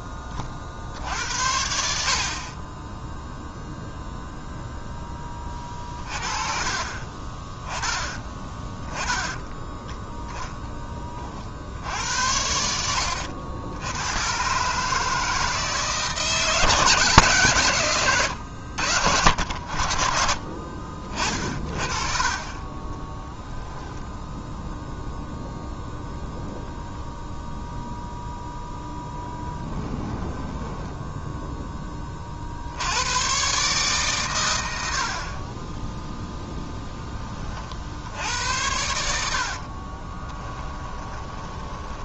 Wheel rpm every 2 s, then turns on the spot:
50, 20, 10, 30, 10, 10, 80, 150, 150, 80, 50, 20, 0, 0, 0, 10, 70, 90, 10, 80, 10.
6-8 22-24 30-32 40-42